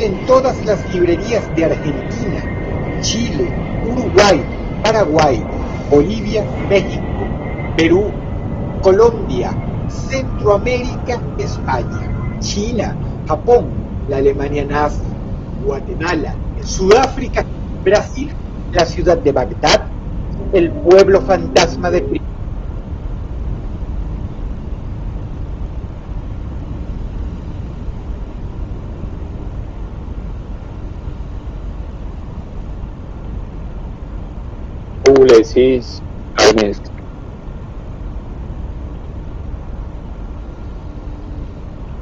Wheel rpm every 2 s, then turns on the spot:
0, 0, 0, 0, 0, 0, 0, 0, 0, 0, 0, 0, 0, 0, 0, 0, 0, 0, 0, 0, 0.
none